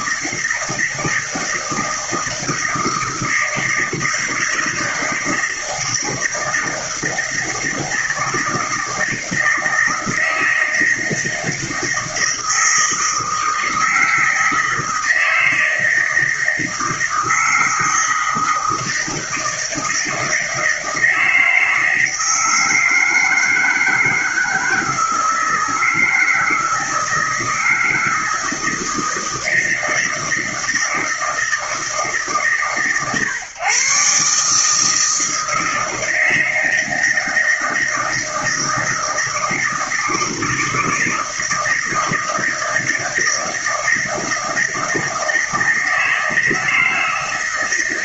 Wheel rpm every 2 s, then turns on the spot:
160, 160, 160, 160, 160, 160, 160, 160, 160, 160, 160, 160, 160, 160, 160, 160, 140, 150, 160, 160, 160, 160, 160, 160.
none